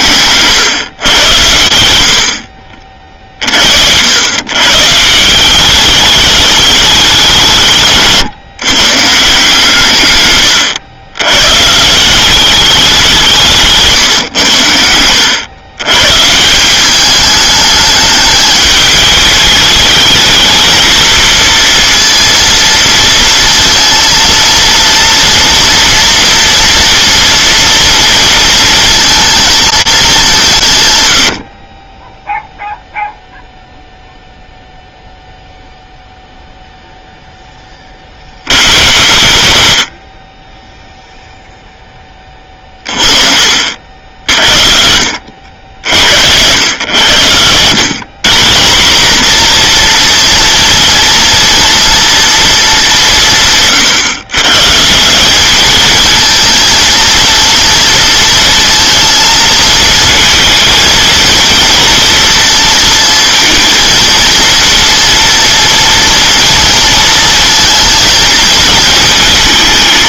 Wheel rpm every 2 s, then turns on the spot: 120, 60, 130, 210, 130, 110, 200, 100, 170, 210, 220, 230, 230, 230, 230, 150, 0, 0, 0, 50, 10, 20, 60, 100, 180, 240, 230, 130, 220, 230, 230, 230, 230, 230, 220.
none